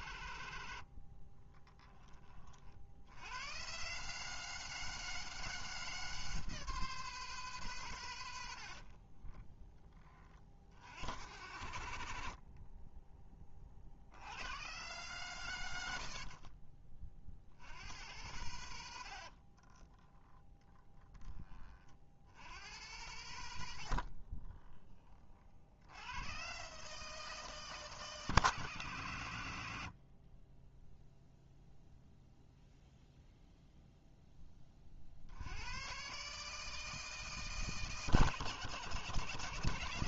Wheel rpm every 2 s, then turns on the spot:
70, 70, 160, 160, 60, 80, 30, 120, 40, 80, 10, 100, 30, 150, 140, 0, 0, 40, 160, 160.
0-2 8-10 12-14 18-20